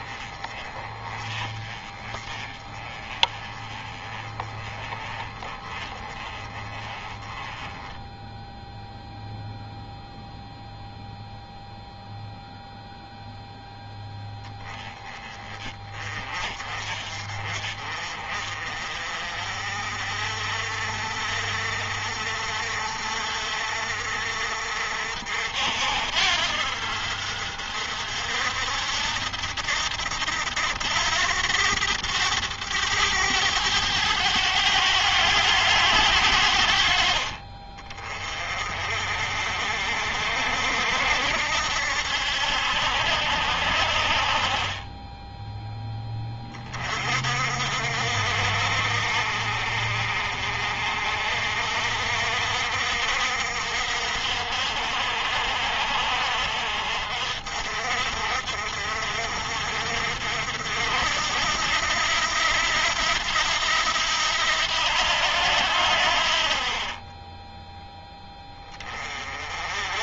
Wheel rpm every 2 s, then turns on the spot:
20, 20, 20, 20, 0, 0, 0, 20, 40, 40, 50, 60, 60, 60, 70, 90, 100, 100, 50, 50, 70, 70, 10, 40, 50, 50, 60, 60, 60, 60, 70, 80, 80, 30, 30.
44-46